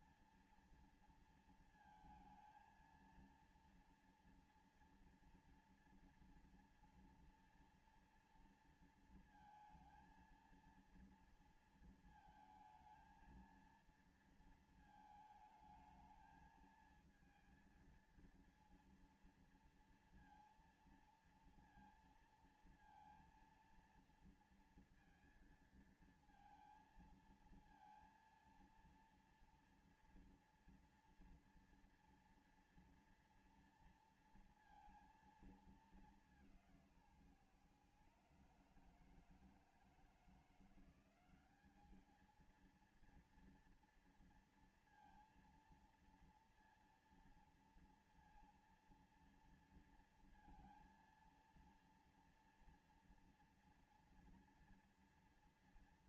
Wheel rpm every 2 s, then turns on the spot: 240, 230, 230, 230, 230, 230, 230, 230, 220, 220, 230, 230, 230, 230, 230, 230, 230, 230, 220, 150, 160, 190, 230, 230, 230, 230, 230, 230.
none